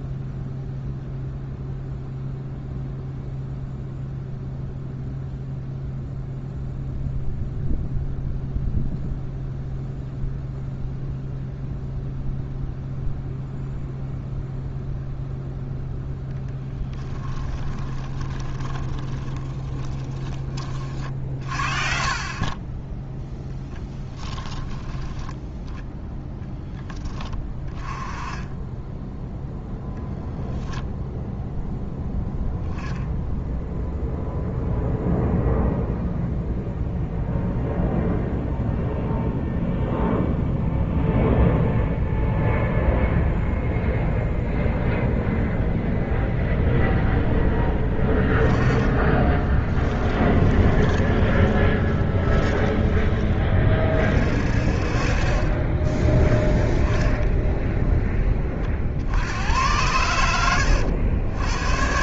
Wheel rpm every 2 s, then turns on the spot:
0, 0, 0, 0, 0, 0, 0, 0, 10, 20, 30, 20, 10, 10, 10, 0, 0, 0, 0, 0, 0, 0, 0, 0, 20, 20, 30, 40, 10, 50, 90.
18-20 48-52